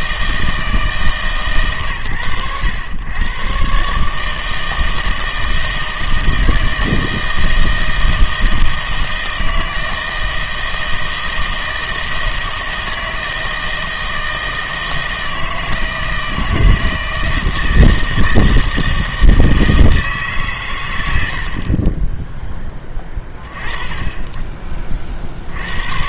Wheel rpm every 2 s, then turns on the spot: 160, 100, 160, 160, 160, 160, 160, 160, 160, 160, 120, 10, 30.
none